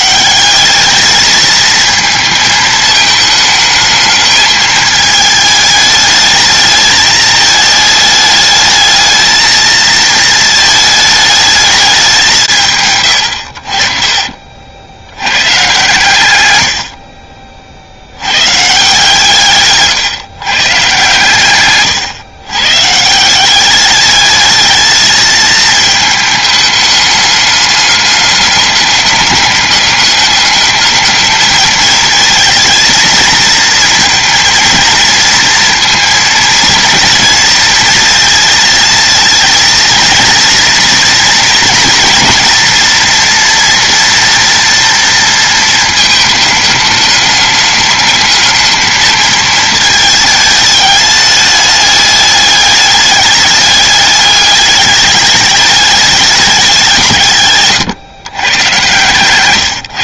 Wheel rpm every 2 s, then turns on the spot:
210, 220, 220, 210, 220, 220, 100, 70, 70, 130, 130, 140, 220, 210, 200, 210, 230, 230, 230, 230, 230, 230, 230, 210, 220, 210, 210, 210, 180, 130.
none